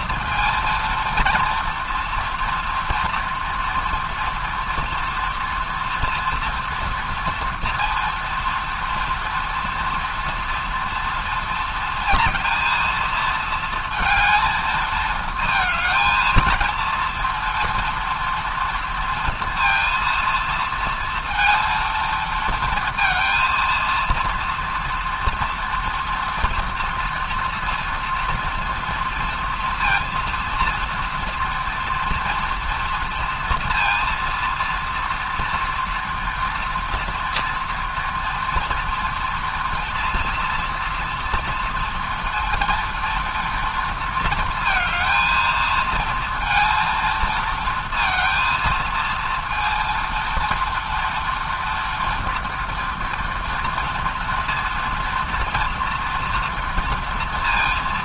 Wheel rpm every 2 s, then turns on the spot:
230, 230, 230, 230, 230, 230, 230, 220, 220, 230, 230, 230, 230, 230, 230, 230, 230, 230, 240, 230, 230, 230, 220, 230, 230, 230, 230, 230, 240.
none